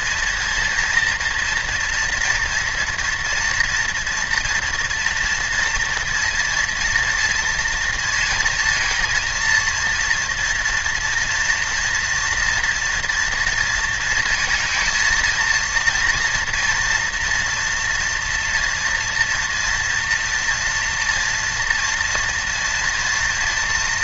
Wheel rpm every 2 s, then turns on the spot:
230, 230, 230, 230, 230, 240, 230, 230, 230, 230, 230, 230.
none